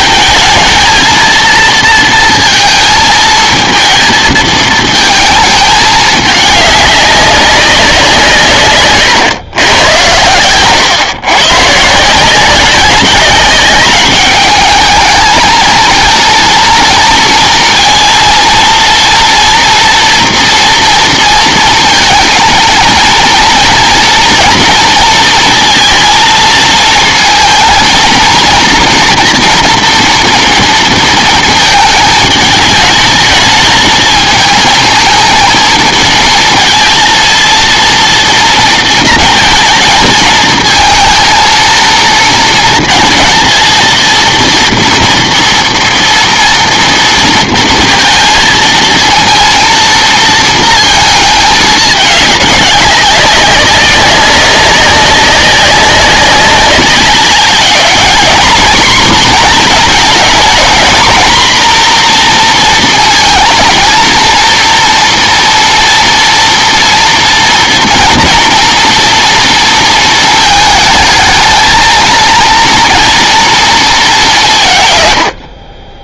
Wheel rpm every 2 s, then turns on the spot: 220, 230, 220, 210, 140, 120, 190, 210, 230, 230, 230, 230, 240, 230, 240, 230, 210, 220, 230, 230, 220, 220, 230, 230, 230, 230, 210, 190, 200, 240, 230, 230, 230, 230, 230, 220, 230, 150.
none